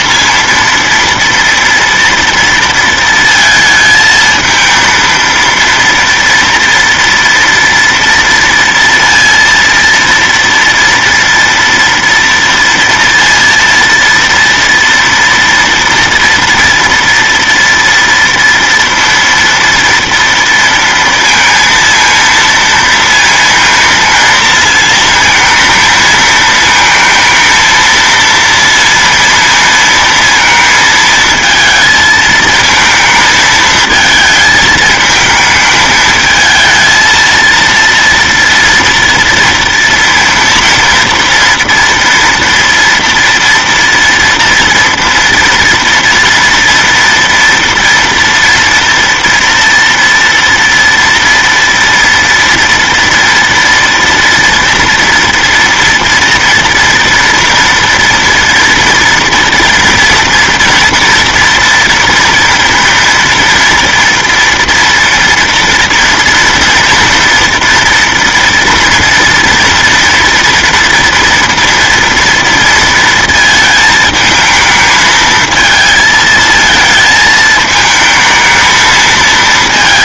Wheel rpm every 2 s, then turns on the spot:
230, 230, 220, 230, 230, 230, 230, 230, 230, 230, 230, 230, 230, 220, 230, 230, 220, 220, 220, 230, 230, 230, 230, 230, 230, 230, 230, 230, 230, 230, 230, 230, 230, 230, 230, 230, 230, 220, 220, 220.
none